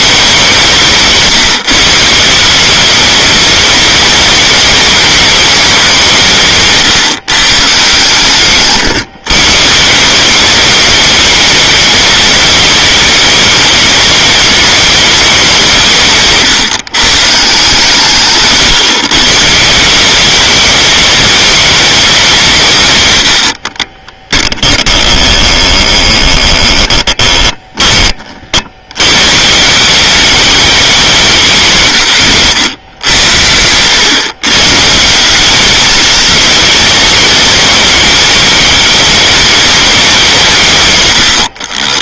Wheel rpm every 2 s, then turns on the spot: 190, 180, 210, 150, 130, 200, 210, 210, 140, 130, 210, 170, 10, 20, 60, 200, 110, 130, 220, 210, 160.
8-10 24-28